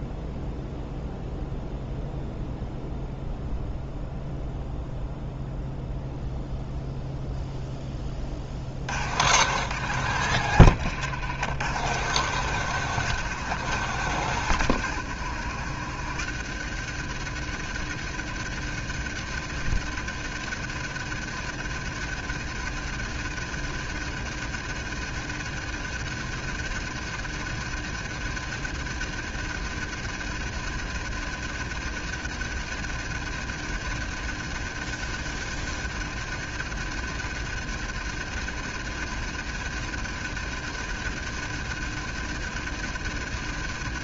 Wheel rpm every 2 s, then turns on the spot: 0, 0, 0, 0, 70, 100, 140, 110, 100, 100, 100, 100, 100, 100, 100, 100, 100, 100, 100, 100, 100, 100.
none